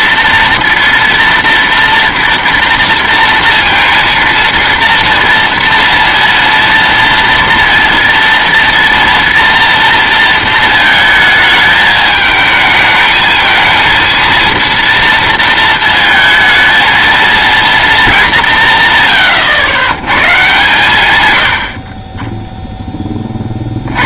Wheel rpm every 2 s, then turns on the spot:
230, 230, 230, 230, 230, 230, 220, 230, 220, 150, 130, 0.
none